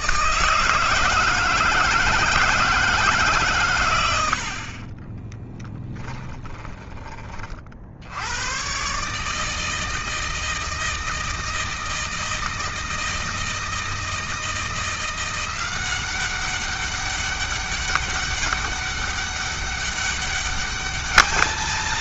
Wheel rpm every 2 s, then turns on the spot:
160, 150, 30, 20, 140, 160, 160, 170, 190, 200, 210.
4-6